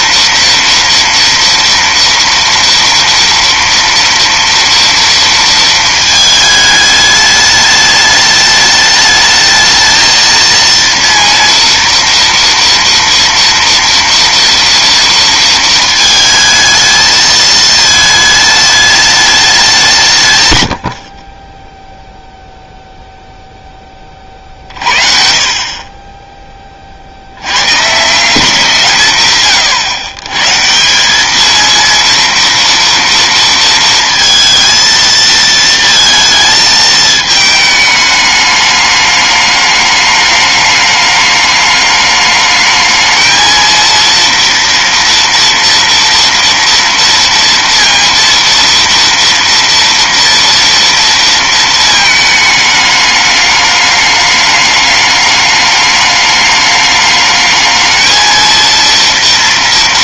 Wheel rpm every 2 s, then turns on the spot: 230, 230, 230, 210, 210, 230, 230, 230, 220, 220, 100, 0, 40, 30, 170, 150, 230, 230, 220, 210, 210, 220, 230, 230, 230, 230, 210, 210, 210, 230.
none